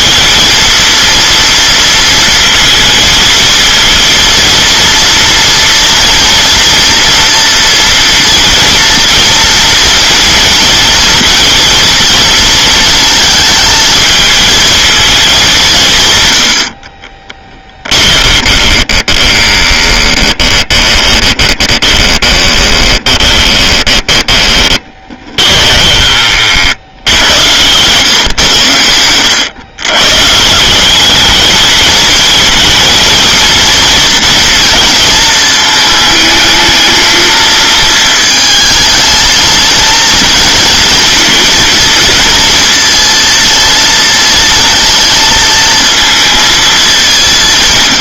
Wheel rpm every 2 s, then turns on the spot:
230, 230, 230, 230, 230, 230, 230, 230, 70, 20, 20, 20, 20, 60, 110, 160, 220, 230, 220, 220, 230, 230, 230, 220.
18-26